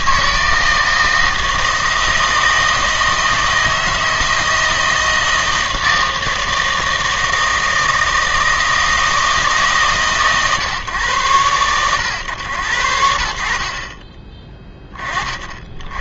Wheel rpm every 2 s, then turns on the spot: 160, 160, 160, 160, 160, 140, 90, 20.
none